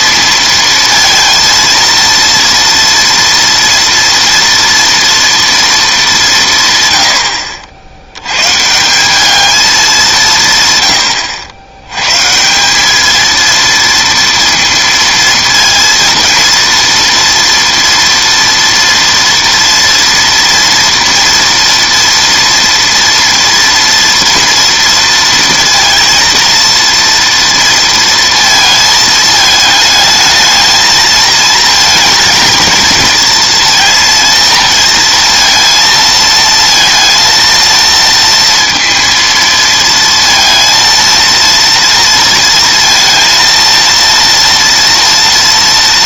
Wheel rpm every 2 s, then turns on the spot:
230, 230, 230, 140, 140, 150, 180, 230, 230, 230, 240, 230, 230, 230, 220, 220, 220, 230, 220, 230, 230, 230, 230.
none